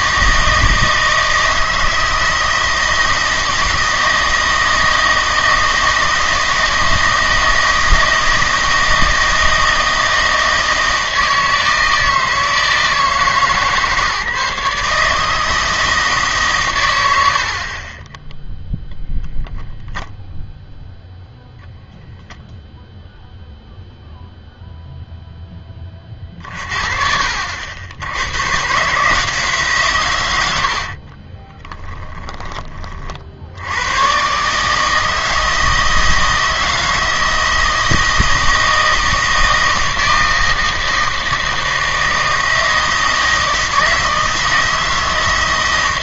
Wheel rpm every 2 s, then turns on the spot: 160, 160, 160, 160, 160, 160, 160, 150, 110, 0, 0, 0, 0, 40, 130, 80, 20, 150, 160, 160, 160, 160, 160.
30-32